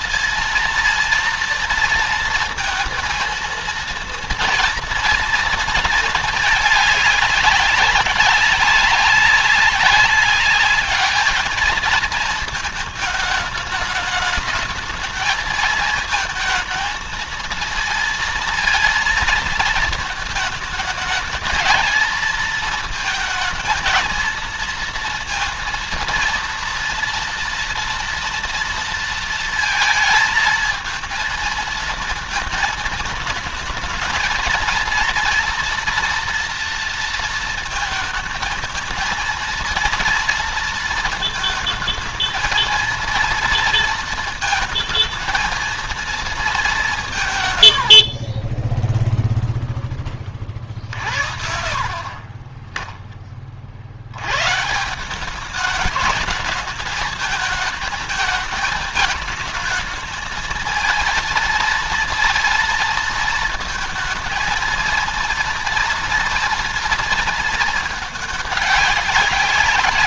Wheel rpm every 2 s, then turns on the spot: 230, 230, 230, 210, 200, 210, 220, 210, 220, 230, 220, 220, 230, 230, 230, 230, 220, 230, 230, 220, 230, 230, 220, 190, 10, 50, 20, 160, 210, 220, 220, 230, 230, 230, 200.
48-50